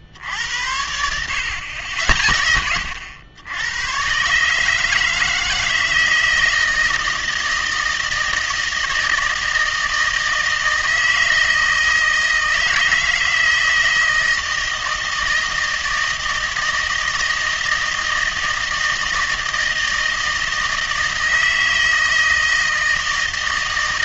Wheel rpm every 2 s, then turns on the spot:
80, 80, 150, 160, 160, 160, 160, 160, 160, 160, 160, 160.
none